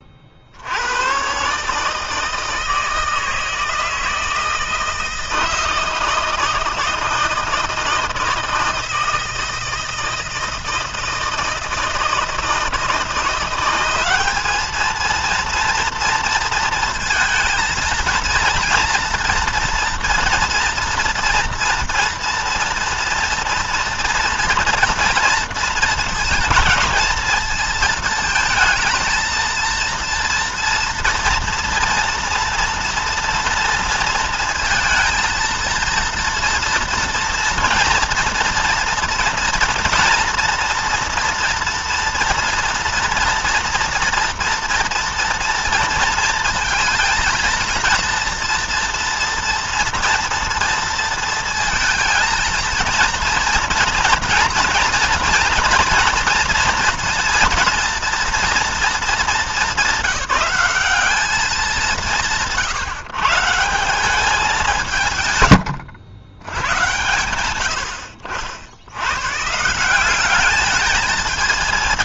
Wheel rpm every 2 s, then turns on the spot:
80, 160, 160, 160, 160, 160, 160, 210, 230, 230, 230, 240, 230, 220, 220, 230, 230, 230, 230, 230, 230, 230, 230, 230, 230, 230, 230, 230, 230, 230, 200, 150, 180, 100, 80, 200.
none